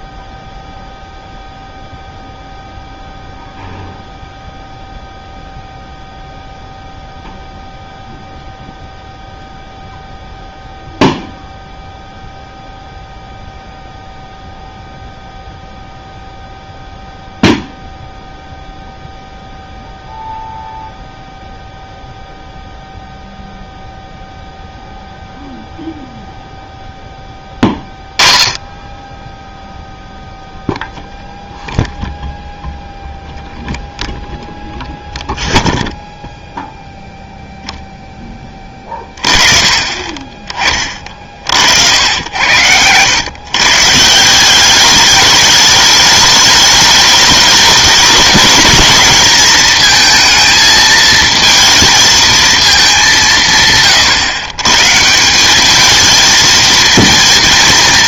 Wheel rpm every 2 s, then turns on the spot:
0, 0, 0, 0, 0, 0, 0, 0, 0, 0, 0, 0, 0, 0, 20, 0, 0, 0, 0, 20, 30, 90, 190, 210, 210, 220, 220, 130, 220.
40-42